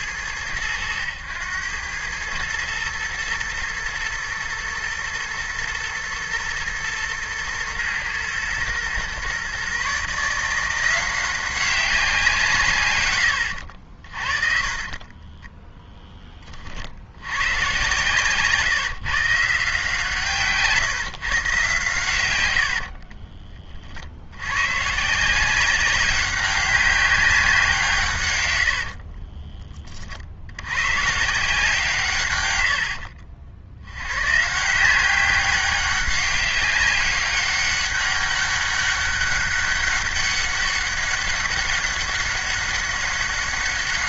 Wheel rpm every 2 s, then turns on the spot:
90, 110, 110, 110, 120, 170, 130, 40, 40, 150, 150, 90, 110, 190, 100, 100, 90, 150, 200, 200, 200, 200.
14-16 22-24